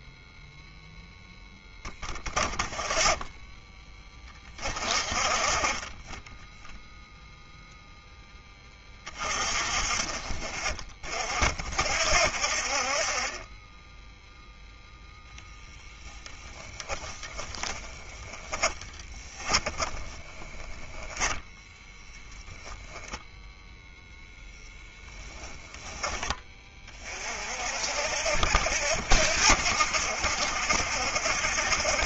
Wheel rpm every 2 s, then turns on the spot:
10, 20, 40, 0, 40, 60, 10, 10, 30, 10, 10, 0, 20, 60, 70, 70.
16-22